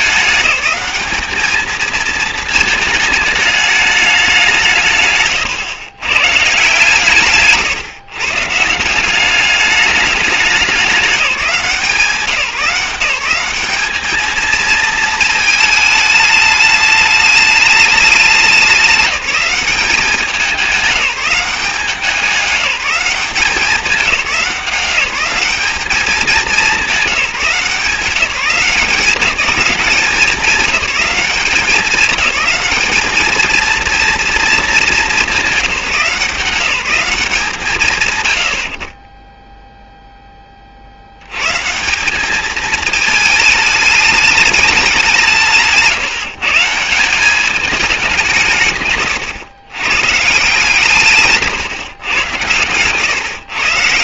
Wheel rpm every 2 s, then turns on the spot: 210, 220, 170, 140, 150, 200, 180, 220, 210, 200, 190, 190, 190, 200, 180, 190, 200, 210, 170, 80, 30, 220, 210, 170, 160, 160, 120.
none